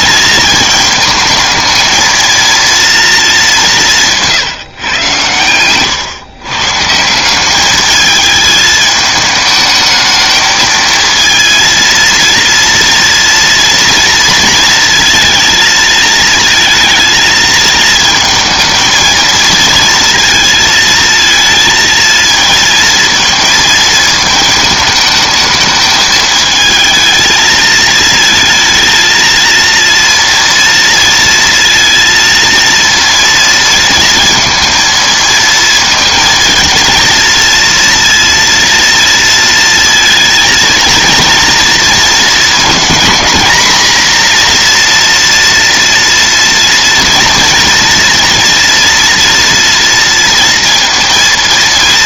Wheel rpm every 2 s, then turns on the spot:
220, 230, 130, 160, 220, 230, 230, 230, 220, 220, 220, 230, 220, 220, 230, 230, 230, 230, 220, 230, 230, 230, 240, 230, 230, 230.
none